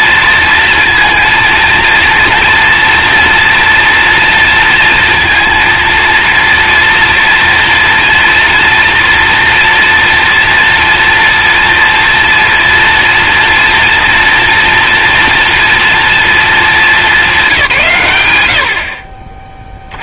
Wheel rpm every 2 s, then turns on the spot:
230, 230, 230, 230, 230, 230, 230, 240, 220, 80.
none